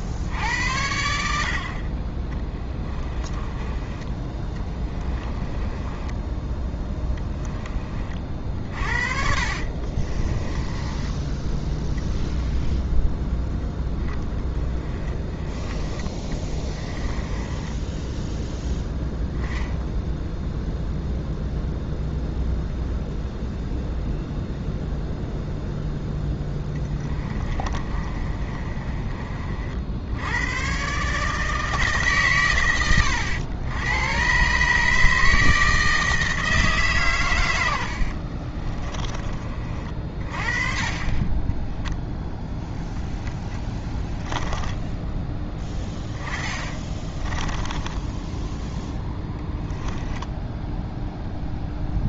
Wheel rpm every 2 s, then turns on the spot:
80, 10, 20, 10, 50, 20, 0, 20, 20, 0, 0, 0, 0, 10, 30, 130, 100, 150, 140, 30, 30, 0, 10, 20, 10, 0.
2-12 14-18 26-30 46-48